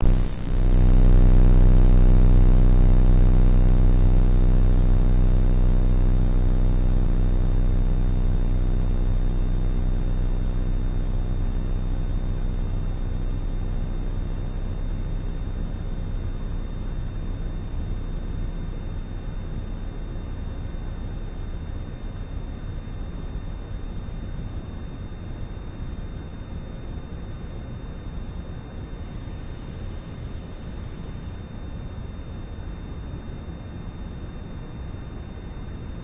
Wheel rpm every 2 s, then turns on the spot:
0, 0, 0, 0, 0, 0, 0, 0, 0, 0, 0, 0, 0, 0, 0, 0, 0, 0.
none